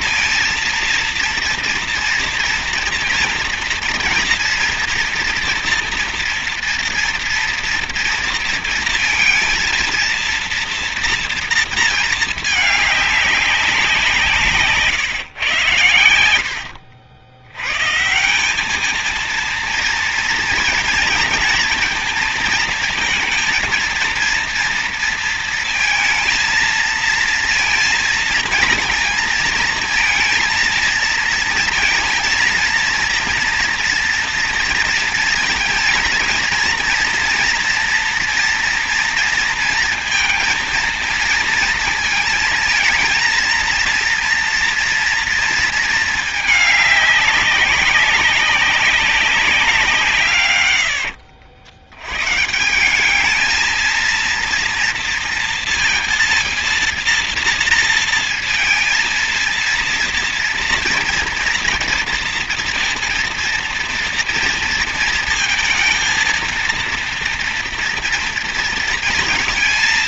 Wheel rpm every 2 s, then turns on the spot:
230, 240, 240, 230, 230, 230, 210, 140, 90, 220, 230, 230, 230, 230, 230, 230, 230, 230, 240, 230, 230, 230, 230, 200, 190, 90, 190, 230, 230, 230, 230, 230, 230, 230, 230.
50-52